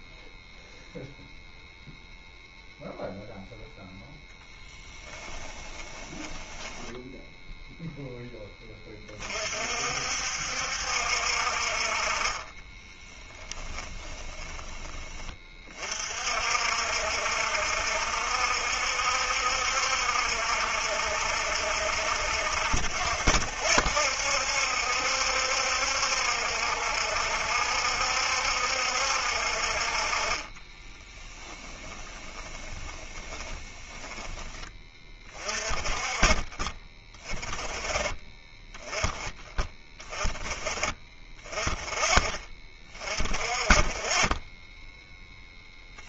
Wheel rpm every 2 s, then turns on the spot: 0, 0, 10, 10, 20, 60, 20, 20, 60, 70, 70, 60, 70, 70, 70, 20, 20, 20, 30, 10, 30, 30, 10.
4-8 12-14 30-34